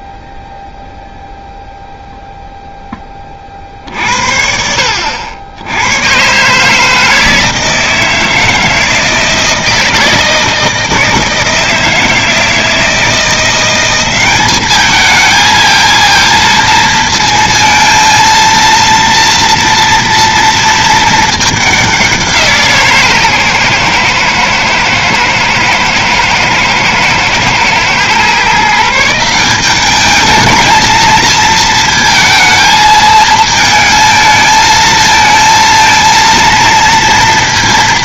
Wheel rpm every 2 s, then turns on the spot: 0, 0, 70, 150, 160, 160, 160, 200, 230, 230, 230, 160, 120, 110, 150, 220, 220, 220, 230.
none